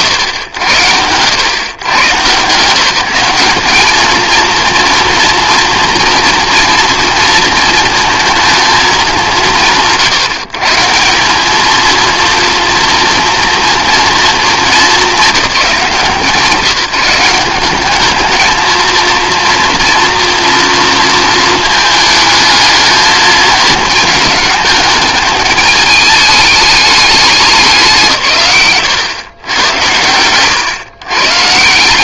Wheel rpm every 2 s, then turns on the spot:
100, 170, 230, 230, 210, 160, 230, 220, 160, 220, 230, 220, 220, 210, 130, 120.
none